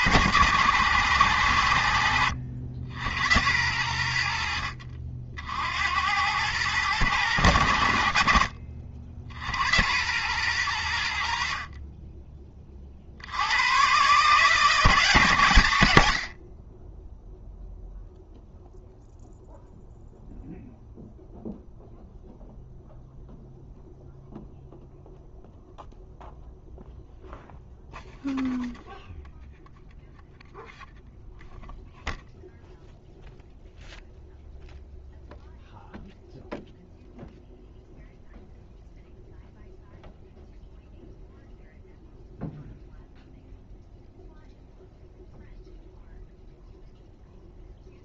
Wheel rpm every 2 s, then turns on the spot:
110, 80, 60, 100, 50, 90, 60, 160, 10, 0, 0, 0, 0, 0, 0, 0, 0, 0, 0, 0, 0, 0, 0, 0.
none